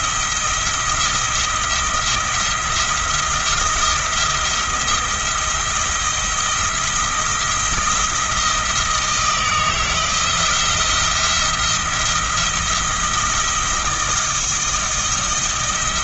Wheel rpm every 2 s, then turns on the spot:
170, 170, 170, 170, 160, 170, 170, 170.
none